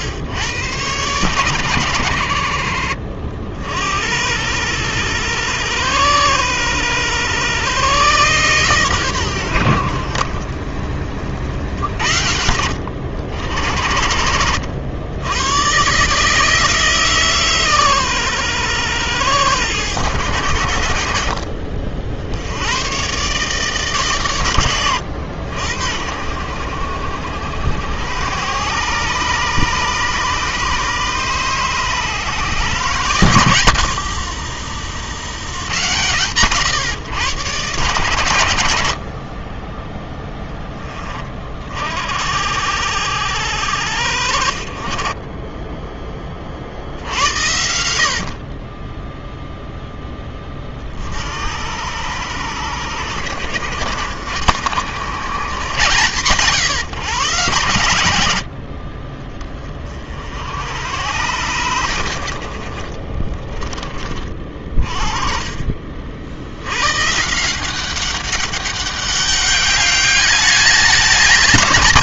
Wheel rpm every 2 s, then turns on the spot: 110, 70, 100, 110, 130, 40, 70, 100, 150, 110, 90, 90, 90, 80, 120, 140, 150, 70, 130, 70, 10, 70, 40, 60, 30, 40, 90, 100, 130, 50, 90, 50, 40, 110, 200, 210.
34-36 44-46 62-64